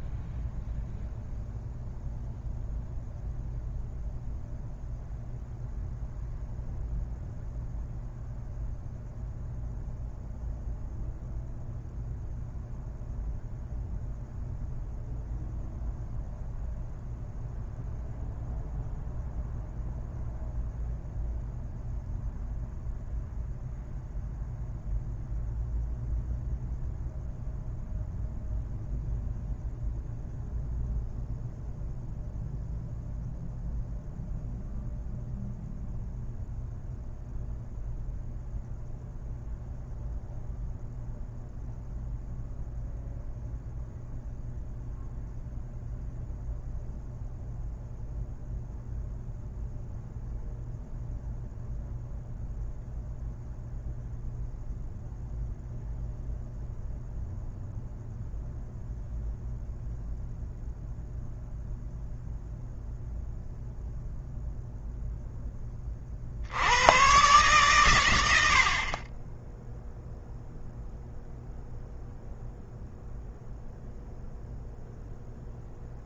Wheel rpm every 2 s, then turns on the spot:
0, 0, 0, 0, 0, 0, 0, 0, 0, 0, 0, 0, 0, 0, 0, 0, 0, 0, 0, 0, 0, 0, 0, 0, 0, 0, 0, 0, 0, 0, 0, 0, 0, 110, 40, 0, 0, 0.
none